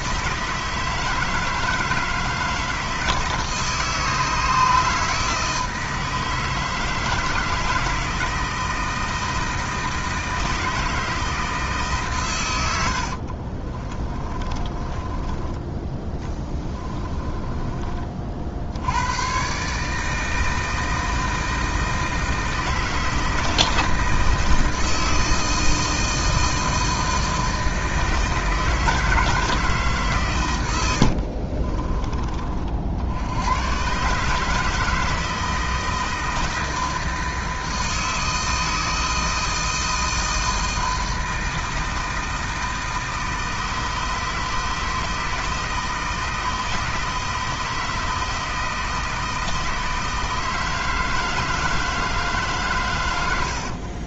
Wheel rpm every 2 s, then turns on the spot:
160, 160, 160, 160, 160, 160, 80, 20, 20, 90, 160, 160, 160, 160, 160, 80, 70, 160, 160, 160, 160, 160, 160, 160, 160, 160, 120.
14-18 30-32